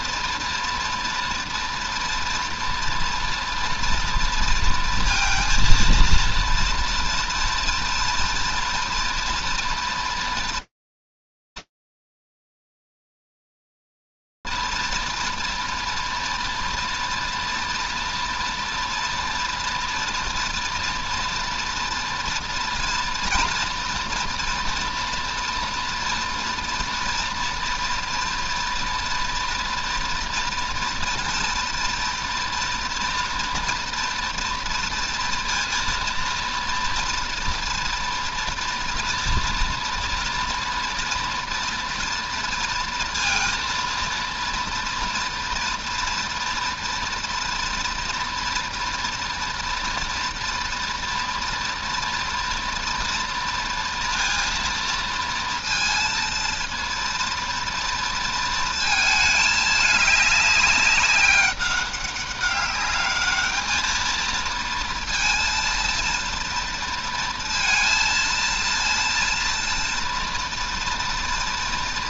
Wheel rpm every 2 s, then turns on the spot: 230, 230, 230, 240, 230, 230, 230, 230, 230, 240, 240, 240, 240, 240, 230, 240, 230, 230, 240, 240, 240, 230, 230, 240, 240, 230, 230, 220, 220, 200, 200, 230, 230, 230, 230, 240.
none